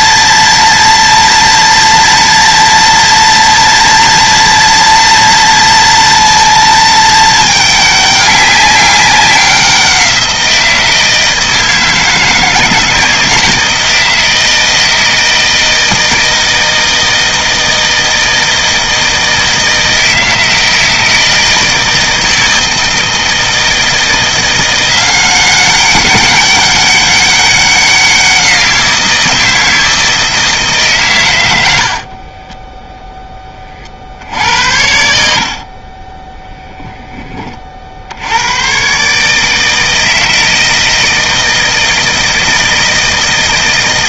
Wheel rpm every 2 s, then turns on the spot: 230, 230, 230, 220, 200, 170, 160, 160, 160, 160, 160, 160, 170, 200, 180, 160, 0, 70, 0, 120, 160, 160.
none